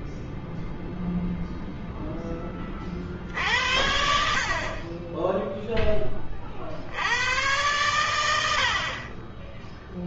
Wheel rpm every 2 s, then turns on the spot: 0, 50, 20, 80, 40.
none